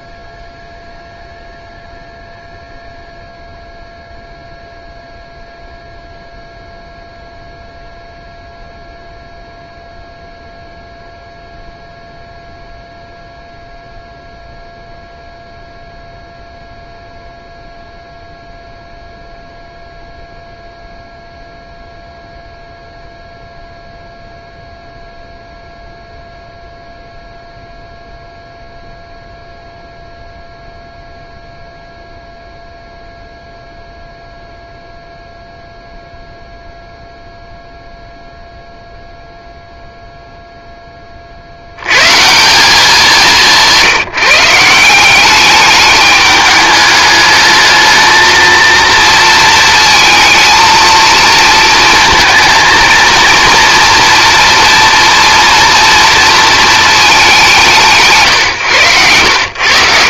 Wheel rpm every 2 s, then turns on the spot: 0, 0, 0, 0, 0, 0, 0, 0, 0, 0, 0, 0, 0, 0, 0, 0, 0, 0, 0, 0, 10, 190, 190, 210, 230, 230, 230, 240, 220, 110.
none